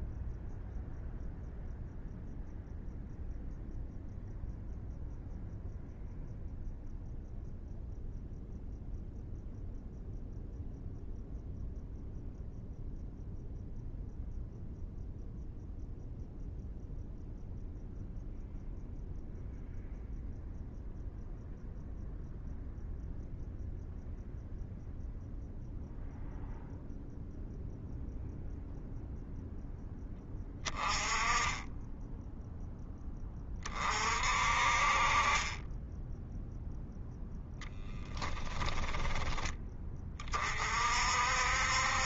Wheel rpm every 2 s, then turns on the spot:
0, 0, 0, 0, 0, 0, 0, 0, 0, 0, 0, 0, 0, 0, 0, 10, 0, 40, 0, 10, 40.
38-40